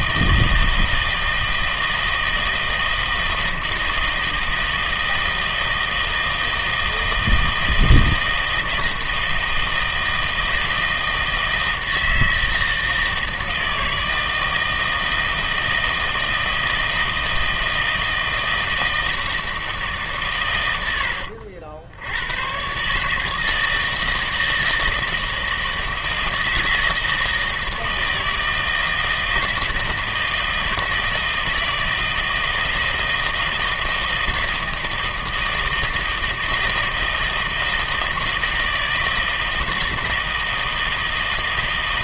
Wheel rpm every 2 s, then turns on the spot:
160, 160, 160, 160, 160, 160, 160, 160, 160, 160, 90, 140, 160, 160, 160, 160, 160, 160, 160, 160, 160.
none